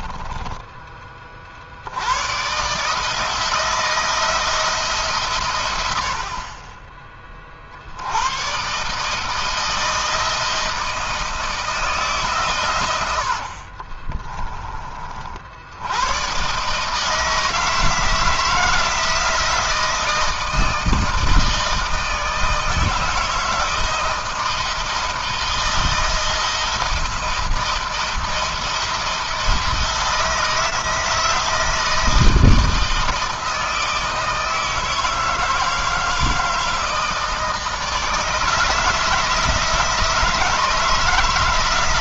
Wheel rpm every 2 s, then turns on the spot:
20, 150, 150, 20, 140, 160, 100, 30, 150, 160, 160, 160, 160, 170, 170, 160, 160, 160, 160, 160, 160.
none